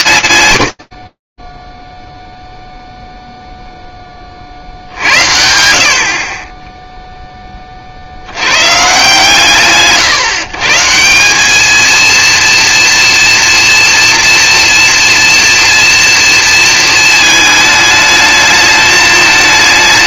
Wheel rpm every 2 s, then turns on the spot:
40, 0, 50, 10, 140, 150, 230, 230, 220, 210.
none